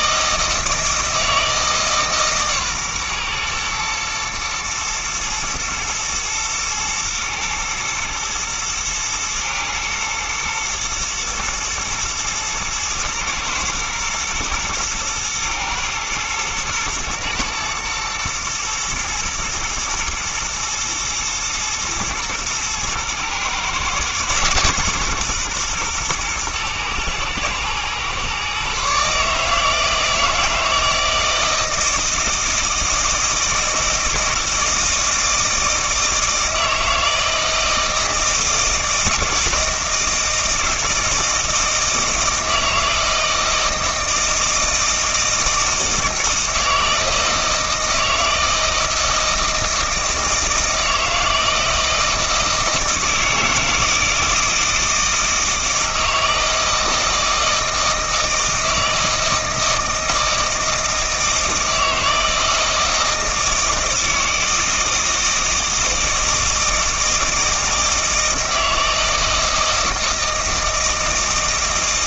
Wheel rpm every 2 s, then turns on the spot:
160, 130, 120, 110, 120, 120, 110, 120, 120, 120, 110, 110, 140, 110, 140, 160, 160, 160, 160, 160, 160, 160, 160, 160, 160, 160, 160, 160, 160, 160, 160, 160, 160, 160, 160, 160.
none